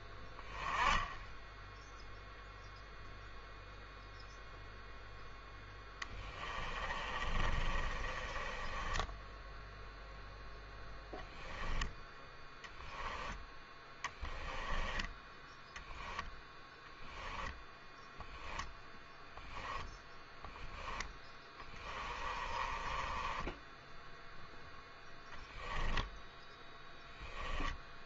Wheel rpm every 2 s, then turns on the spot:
10, 0, 0, 20, 10, 10, 10, 10, 0, 0, 20, 20, 0, 10.
6-10 14-16 20-24 26-28